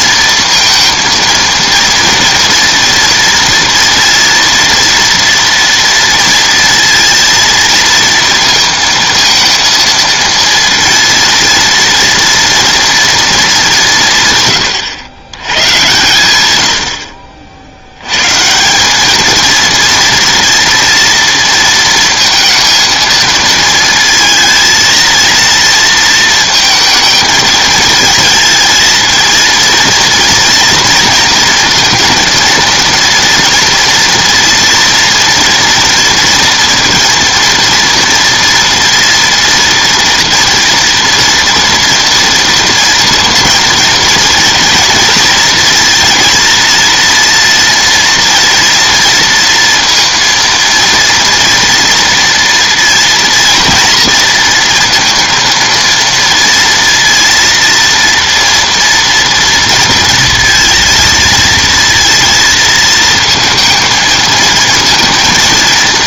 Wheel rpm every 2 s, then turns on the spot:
230, 230, 230, 230, 230, 230, 230, 120, 90, 170, 230, 220, 230, 230, 220, 230, 230, 230, 230, 230, 230, 230, 230, 230, 230, 230, 230, 230, 230, 230, 230, 220, 230.
none